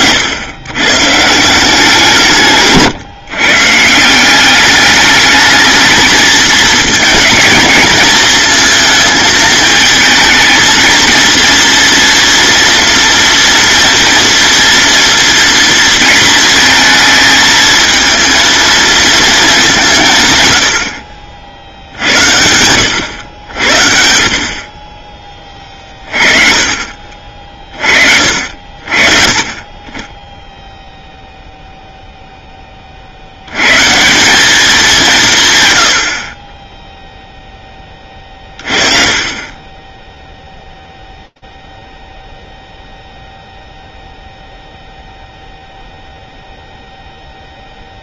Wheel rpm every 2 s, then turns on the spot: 130, 140, 210, 230, 220, 230, 230, 230, 230, 230, 60, 100, 30, 40, 50, 0, 70, 170, 0, 30, 0, 0, 0, 0.
none